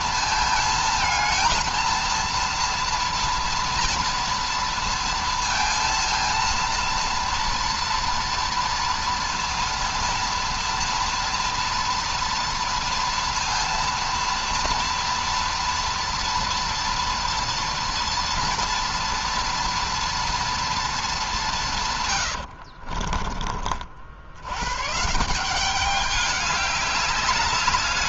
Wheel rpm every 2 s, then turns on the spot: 220, 230, 230, 230, 240, 230, 230, 230, 230, 230, 230, 110, 90, 200.
22-24